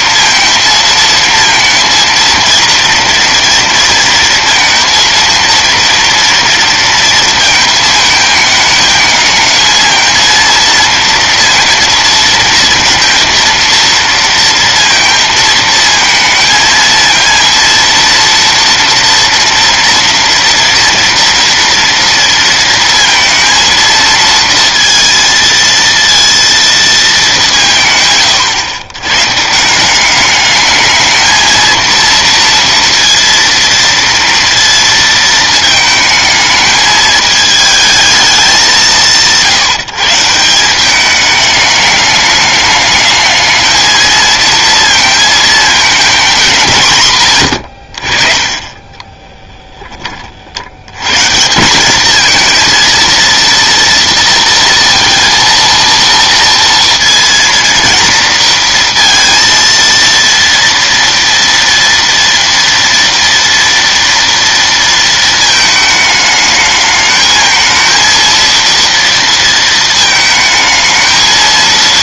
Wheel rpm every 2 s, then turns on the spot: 220, 230, 230, 230, 220, 230, 230, 230, 230, 230, 230, 230, 230, 210, 130, 220, 230, 230, 220, 170, 200, 210, 230, 120, 20, 110, 230, 230, 230, 230, 230, 230, 230, 220, 230, 220.
48-50